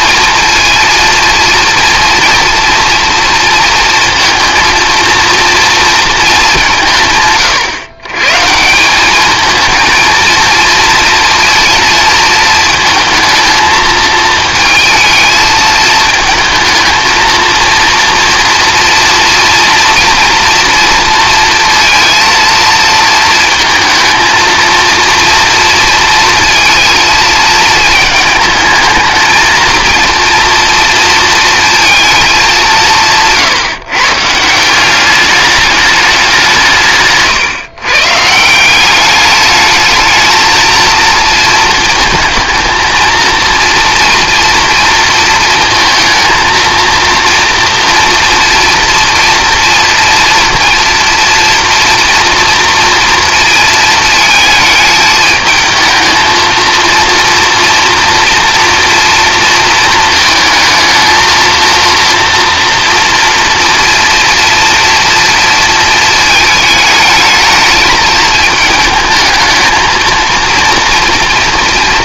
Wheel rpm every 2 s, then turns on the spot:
230, 230, 230, 190, 160, 230, 220, 220, 220, 230, 230, 230, 230, 230, 220, 230, 200, 170, 170, 170, 220, 220, 240, 230, 240, 230, 230, 220, 230, 240, 230, 230, 230, 220, 210, 230.
none